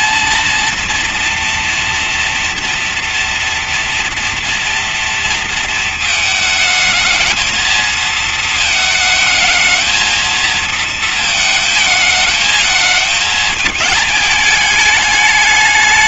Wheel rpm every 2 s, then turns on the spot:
230, 230, 230, 220, 220, 220, 220, 210.
none